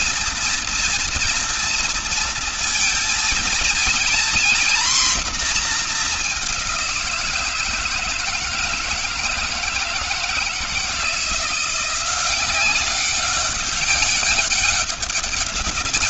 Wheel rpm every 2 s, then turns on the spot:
230, 230, 240, 190, 160, 160, 190, 200.
none